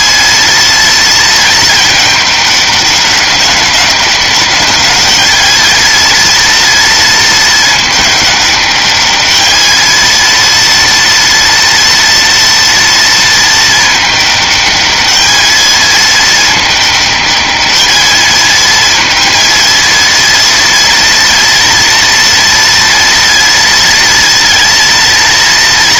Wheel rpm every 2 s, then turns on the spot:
230, 200, 200, 230, 200, 230, 230, 210, 210, 220, 230, 230, 230.
none